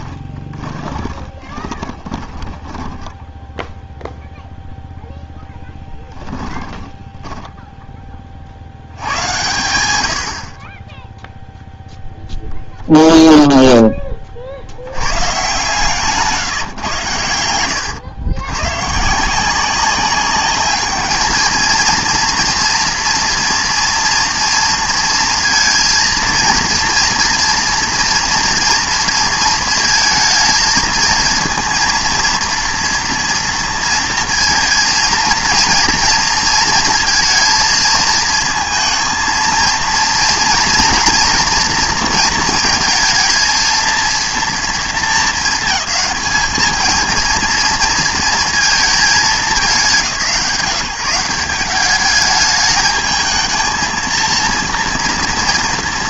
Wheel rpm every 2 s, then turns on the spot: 20, 10, 0, 10, 70, 30, 0, 70, 140, 120, 210, 230, 230, 230, 230, 230, 230, 230, 230, 230, 230, 230, 230, 220, 230, 170, 210, 230.
0-4 6-8 16-18